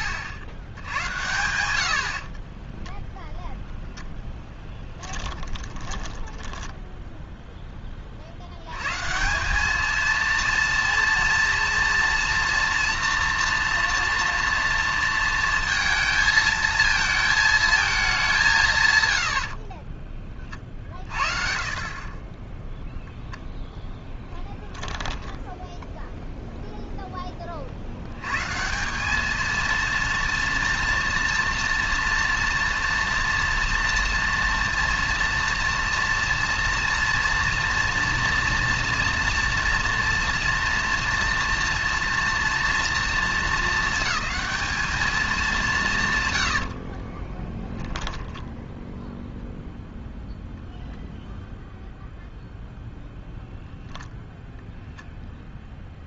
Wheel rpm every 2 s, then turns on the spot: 100, 0, 10, 10, 100, 230, 230, 230, 220, 150, 40, 10, 10, 0, 140, 230, 230, 240, 230, 230, 230, 230, 220, 90, 10, 0, 0, 0.
4-6 46-50